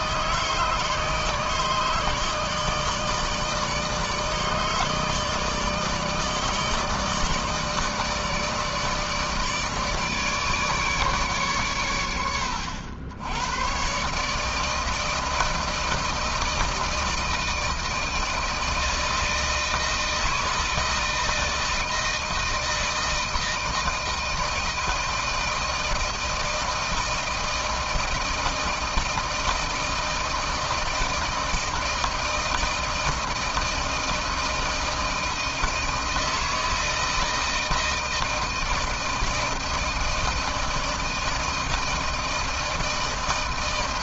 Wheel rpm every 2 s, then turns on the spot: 150, 150, 150, 160, 160, 150, 110, 150, 160, 160, 160, 160, 160, 160, 160, 160, 160, 160, 160, 160, 160, 160.
none